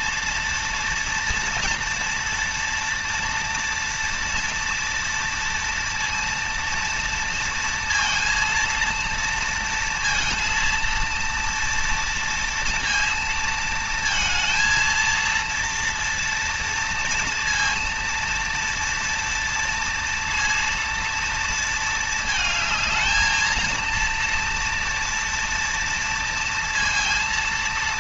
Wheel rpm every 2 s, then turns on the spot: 240, 230, 230, 230, 230, 230, 230, 230, 230, 230, 230, 220, 230, 230.
none